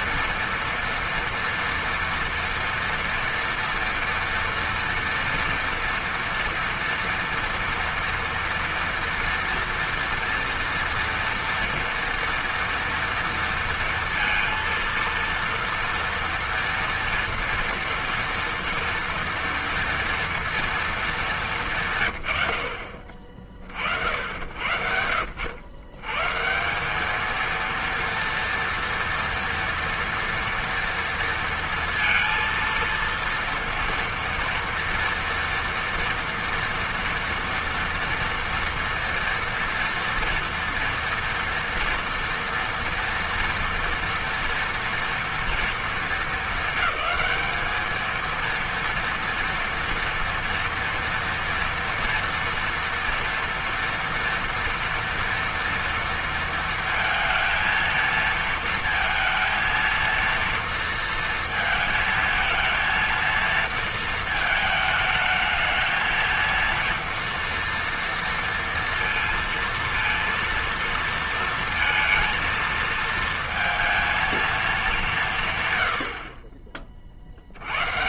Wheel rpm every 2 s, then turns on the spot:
230, 230, 230, 230, 230, 240, 230, 230, 230, 230, 160, 50, 80, 230, 230, 230, 230, 230, 230, 230, 230, 230, 220, 210, 230, 240, 230, 230, 230, 230, 230, 230, 220, 230, 230, 230, 220, 140, 60.
none